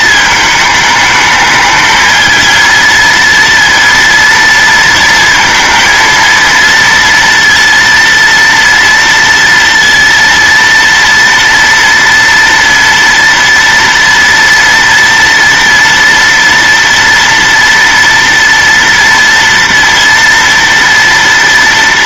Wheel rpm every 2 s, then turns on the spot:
220, 230, 230, 230, 230, 230, 230, 230, 230, 230, 230.
none